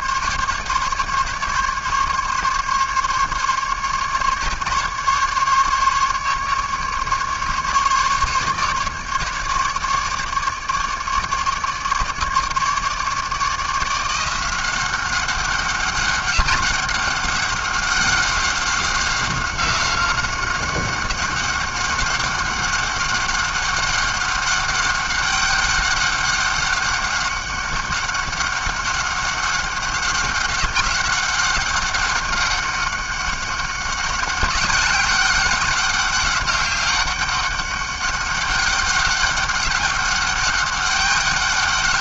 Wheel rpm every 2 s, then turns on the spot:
140, 140, 150, 140, 150, 150, 150, 190, 200, 190, 200, 190, 200, 200, 200, 190, 200, 200, 200, 200, 200.
none